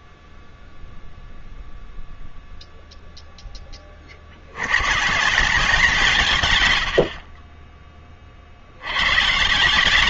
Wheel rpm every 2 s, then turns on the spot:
0, 0, 120, 70, 100.
none